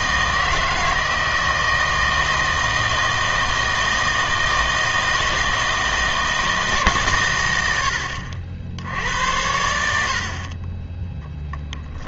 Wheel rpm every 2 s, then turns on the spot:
160, 160, 160, 160, 70, 30.
none